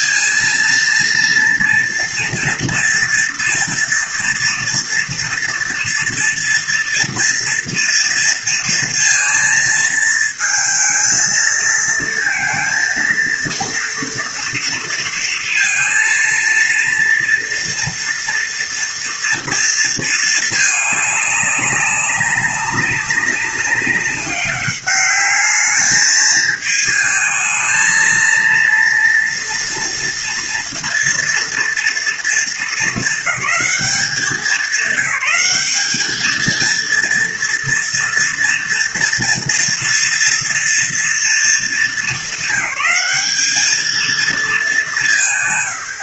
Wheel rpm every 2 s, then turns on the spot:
220, 230, 230, 230, 230, 220, 230, 230, 230, 230, 220, 200, 200, 220, 230, 230, 220, 200, 230, 230, 230, 210, 180.
none